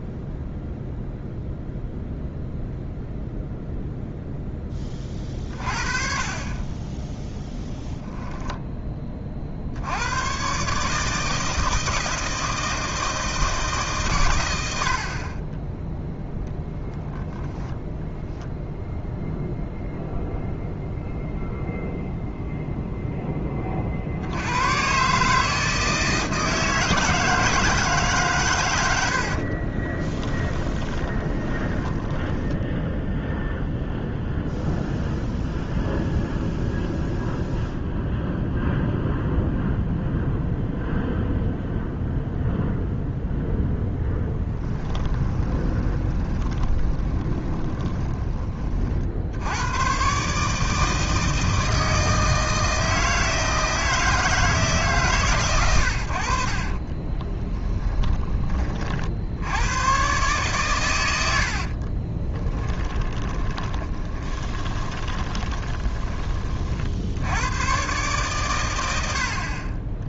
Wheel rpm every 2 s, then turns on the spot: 0, 0, 10, 20, 10, 140, 160, 90, 10, 0, 0, 0, 110, 160, 110, 20, 10, 0, 0, 0, 0, 0, 10, 20, 40, 160, 160, 150, 40, 40, 120, 10, 20, 50, 100.
30-34 44-48 56-58 62-66